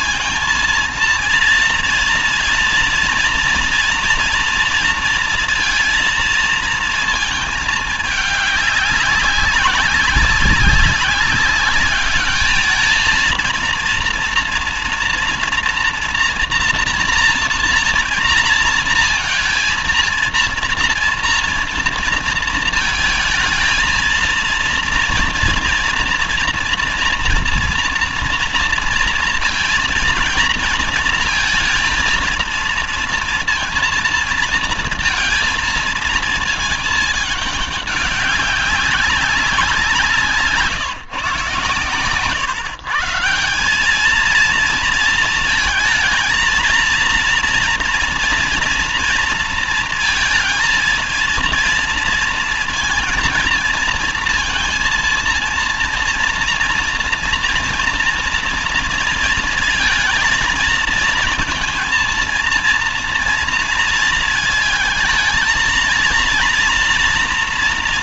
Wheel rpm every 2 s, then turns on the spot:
230, 230, 230, 230, 200, 190, 220, 230, 230, 230, 230, 220, 230, 230, 230, 230, 230, 230, 220, 190, 150, 150, 230, 230, 230, 230, 230, 230, 230, 230, 230, 230, 220, 230.
none